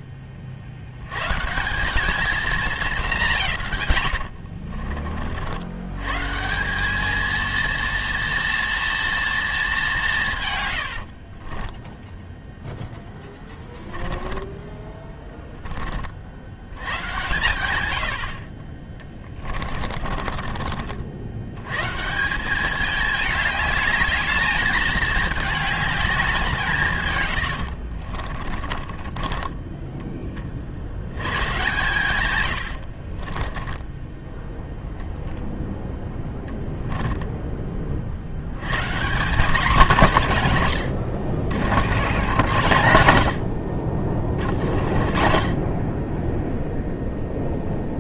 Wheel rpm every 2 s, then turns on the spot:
110, 190, 40, 210, 230, 60, 10, 20, 110, 20, 60, 210, 210, 120, 20, 110, 40, 0, 10, 180, 100, 90, 60, 0.
10-16 18-20 28-30 32-34